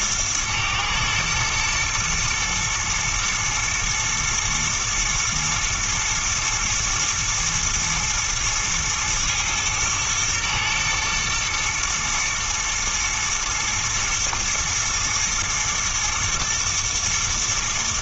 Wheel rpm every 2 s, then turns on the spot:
110, 120, 110, 120, 110, 110, 120, 120, 120.
none